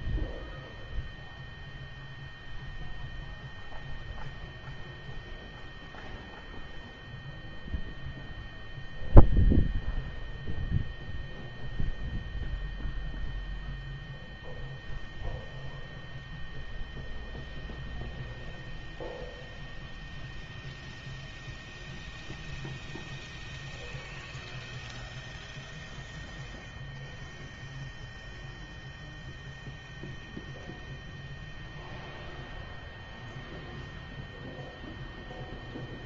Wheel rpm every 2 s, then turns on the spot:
0, 0, 0, 0, 0, 0, 0, 0, 0, 0, 0, 0, 0, 0, 0, 0, 0, 0.
none